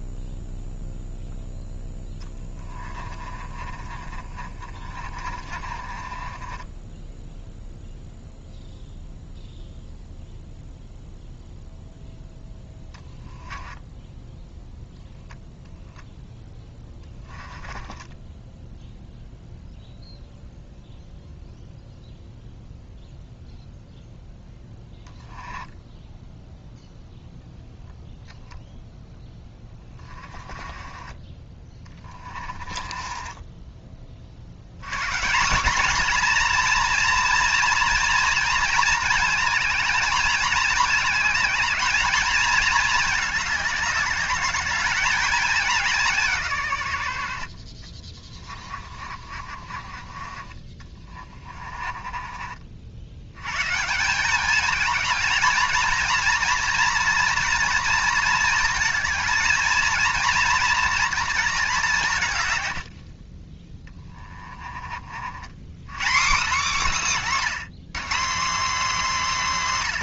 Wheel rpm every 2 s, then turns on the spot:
0, 20, 40, 10, 0, 0, 10, 10, 10, 0, 0, 0, 10, 0, 0, 20, 20, 130, 240, 230, 210, 220, 210, 120, 40, 40, 60, 210, 230, 230, 240, 80, 30, 220, 280.
2-8 16-18 24-26 30-34 48-52 62-64